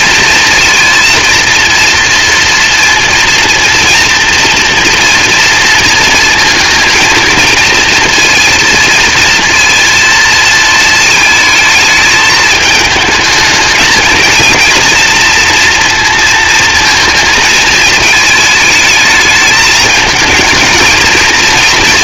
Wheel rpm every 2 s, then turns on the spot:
230, 230, 230, 230, 230, 220, 220, 230, 230, 210, 230.
none